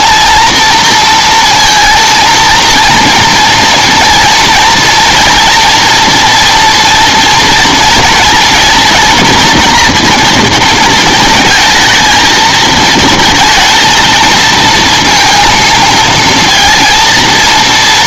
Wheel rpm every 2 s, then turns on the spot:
230, 230, 240, 230, 240, 230, 220, 220, 230.
none